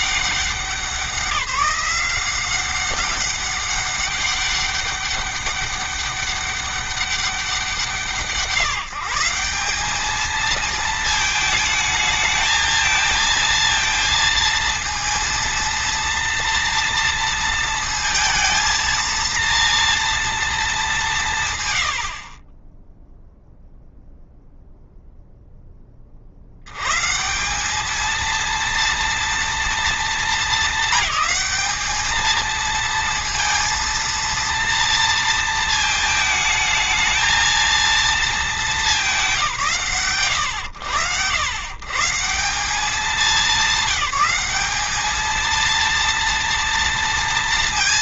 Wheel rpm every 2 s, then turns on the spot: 180, 190, 200, 200, 160, 220, 220, 230, 230, 230, 180, 10, 0, 140, 230, 220, 230, 230, 220, 170, 90, 200, 220, 230.
none